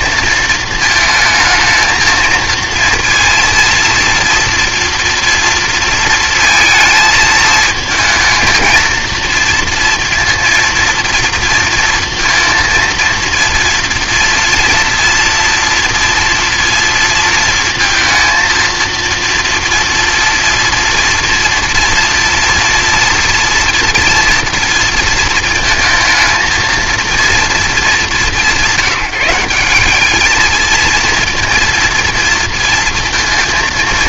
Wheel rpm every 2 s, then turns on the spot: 230, 230, 230, 220, 220, 230, 230, 230, 230, 230, 230, 230, 240, 230, 200, 220, 230.
none